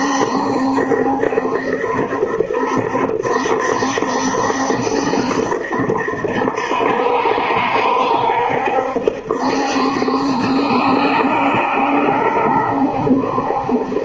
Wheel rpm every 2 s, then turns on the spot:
70, 70, 70, 70, 70, 70, 70.
none